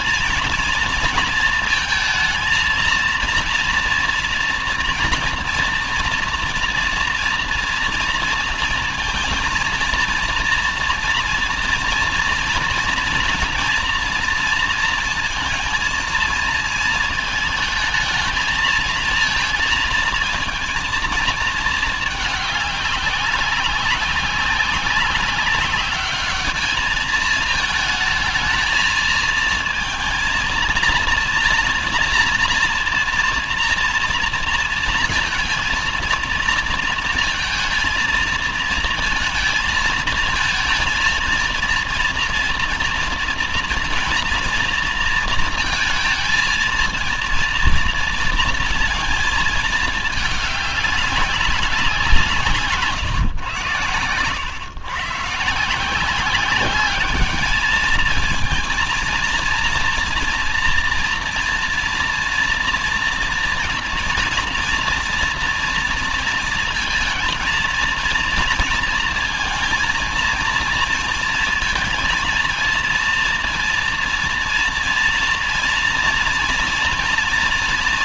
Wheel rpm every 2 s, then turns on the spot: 230, 230, 230, 230, 230, 230, 230, 230, 220, 220, 220, 200, 200, 210, 220, 230, 230, 230, 230, 230, 230, 230, 230, 230, 230, 200, 140, 120, 200, 220, 240, 230, 230, 230, 230, 230, 230, 230, 230.
none